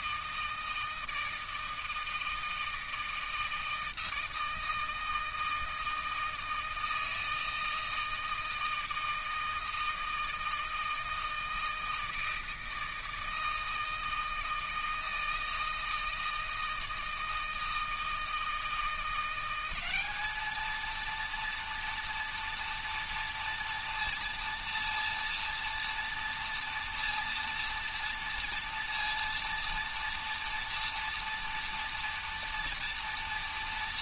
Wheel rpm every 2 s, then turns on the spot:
160, 160, 160, 160, 160, 160, 160, 160, 160, 170, 220, 230, 230, 230, 230, 230, 230.
none